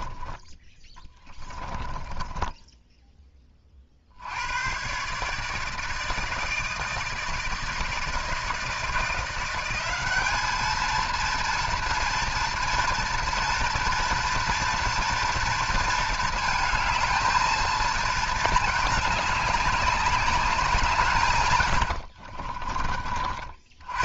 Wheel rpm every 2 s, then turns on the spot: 10, 10, 110, 160, 160, 220, 230, 230, 220, 220, 180, 40.
0-4 22-24